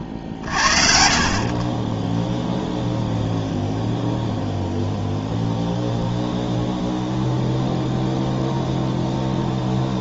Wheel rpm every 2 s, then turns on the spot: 30, 0, 0, 0, 0.
none